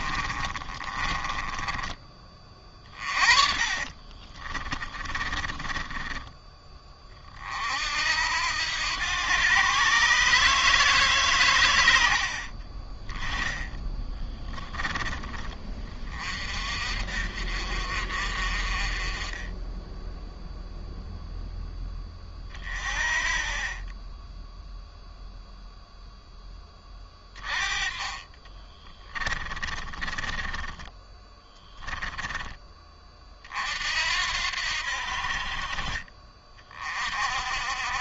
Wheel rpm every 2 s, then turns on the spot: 30, 30, 20, 20, 100, 150, 30, 10, 40, 40, 0, 30, 0, 10, 20, 10, 30, 70, 50.
0-6 28-32